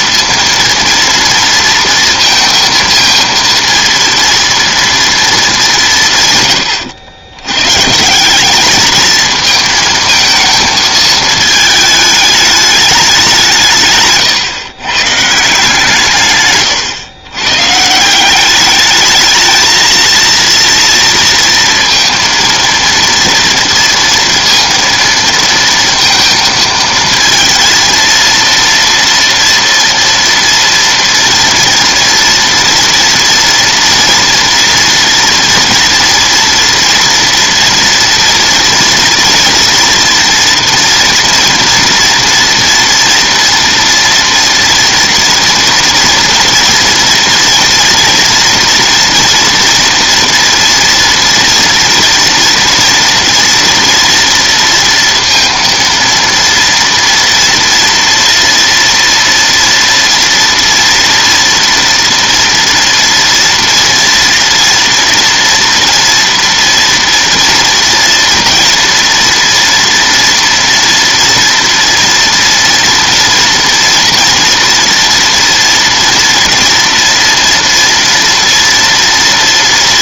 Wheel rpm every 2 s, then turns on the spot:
230, 230, 230, 110, 210, 220, 210, 130, 130, 200, 230, 230, 230, 230, 230, 230, 230, 230, 230, 230, 230, 230, 230, 230, 240, 230, 230, 230, 230, 230, 230, 230, 240, 230, 230, 230, 230, 230, 230, 230.
none